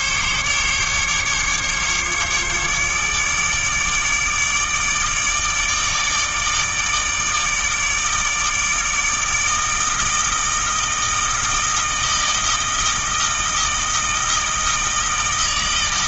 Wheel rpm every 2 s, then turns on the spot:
140, 150, 150, 150, 160, 160, 160, 160.
none